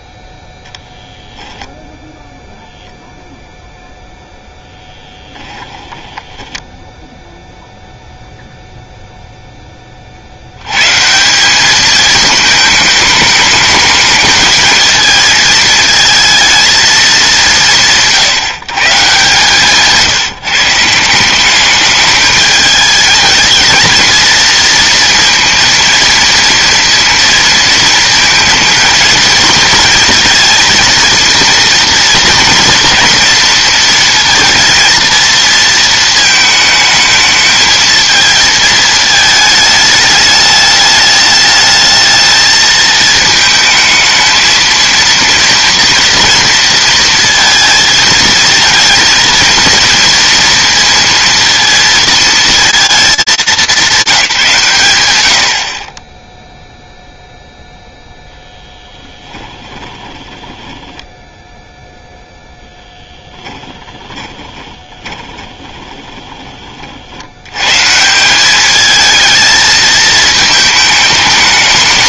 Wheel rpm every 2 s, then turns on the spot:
0, 0, 0, 10, 0, 110, 220, 220, 210, 150, 160, 210, 230, 230, 230, 230, 230, 230, 220, 220, 210, 220, 220, 230, 230, 230, 220, 140, 0, 10, 10, 10, 20, 70, 220, 220.
6-8 58-66